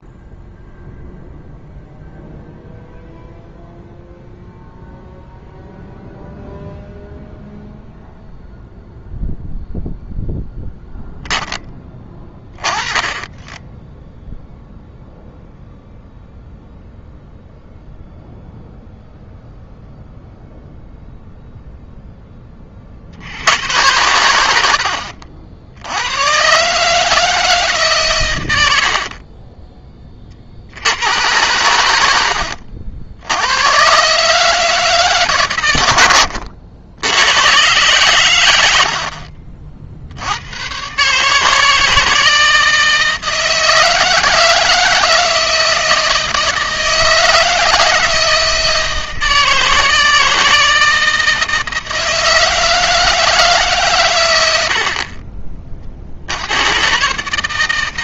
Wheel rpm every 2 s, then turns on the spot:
0, 0, 0, 0, 0, 0, 20, 0, 0, 0, 0, 30, 70, 130, 90, 60, 80, 150, 80, 80, 110, 160, 160, 160, 160, 160, 160, 70, 110.
none